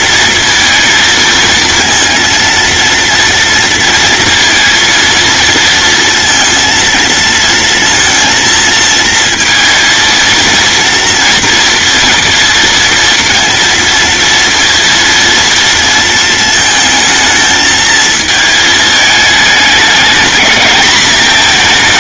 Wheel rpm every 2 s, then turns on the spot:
220, 230, 230, 230, 230, 230, 230, 230, 220, 220, 220.
none